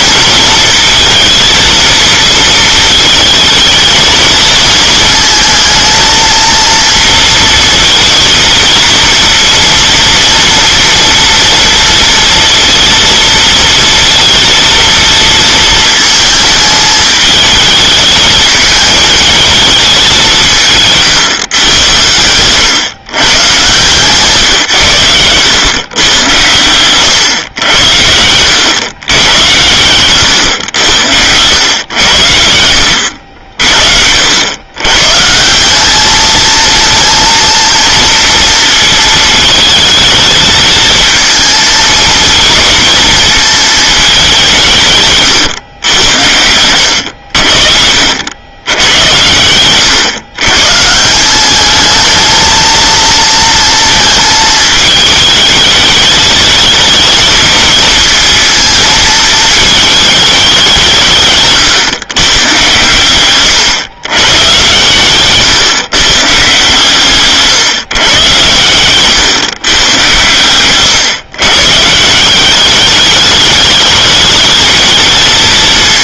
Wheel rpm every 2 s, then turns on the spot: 230, 220, 220, 230, 230, 230, 230, 230, 220, 220, 170, 110, 130, 110, 110, 100, 70, 110, 220, 230, 220, 220, 160, 90, 100, 160, 230, 220, 220, 220, 180, 120, 120, 140, 120, 120, 200, 210.
none